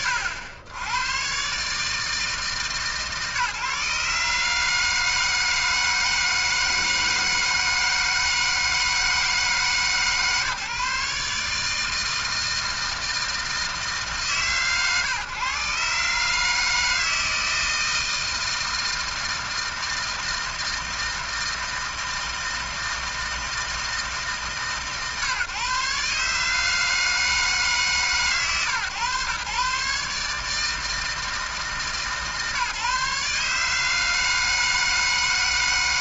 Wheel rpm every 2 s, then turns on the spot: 90, 140, 160, 160, 160, 140, 160, 110, 160, 160, 160, 160, 130, 160, 120, 150, 140, 160.
none